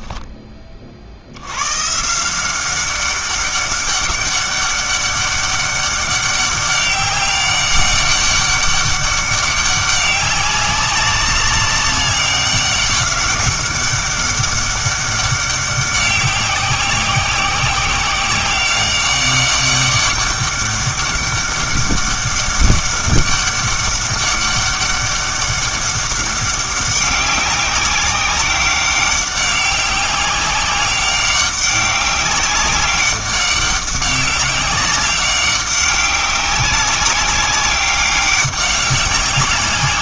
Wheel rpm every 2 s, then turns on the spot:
20, 180, 200, 200, 200, 190, 200, 200, 190, 190, 200, 200, 200, 200, 190, 190, 190, 200, 200, 190.
none